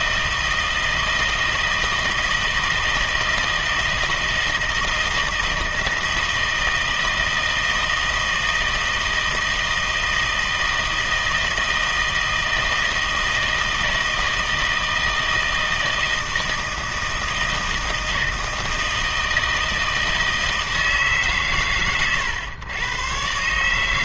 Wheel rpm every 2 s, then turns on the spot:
160, 160, 160, 160, 160, 160, 160, 160, 160, 160, 160, 110.
none